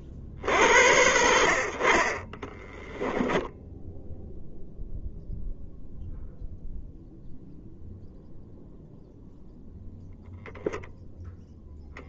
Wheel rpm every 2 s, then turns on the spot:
40, 20, 0, 0, 0, 0.
2-4